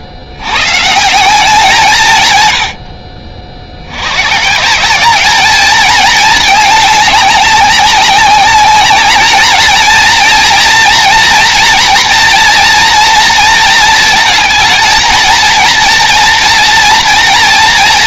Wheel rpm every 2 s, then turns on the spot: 130, 100, 140, 220, 200, 230, 230, 220, 230.
none